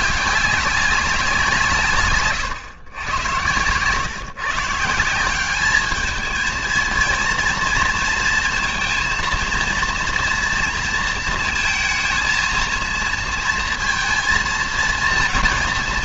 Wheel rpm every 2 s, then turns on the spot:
190, 120, 170, 230, 230, 230, 230, 230.
none